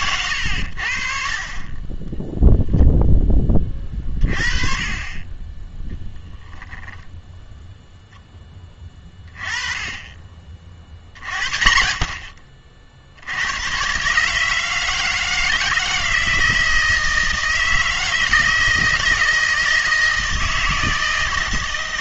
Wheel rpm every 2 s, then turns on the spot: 90, 0, 30, 0, 10, 50, 60, 160, 160, 160, 160.
none